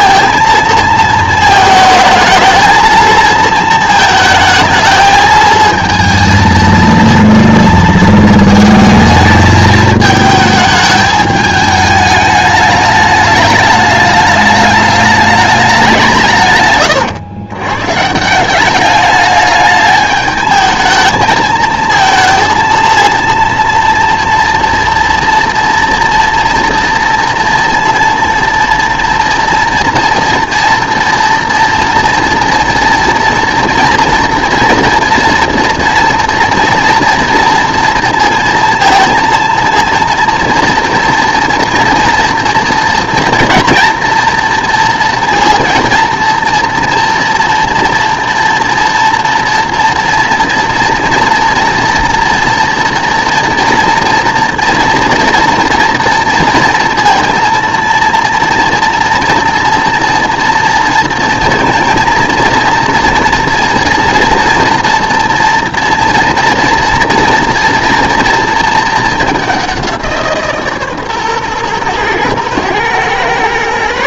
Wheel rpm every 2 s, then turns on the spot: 230, 220, 220, 230, 220, 210, 210, 210, 120, 200, 220, 230, 230, 230, 240, 240, 240, 230, 230, 230, 230, 230, 230, 230, 230, 230, 240, 240, 230, 230, 230, 230, 240, 230, 230, 150, 110.
none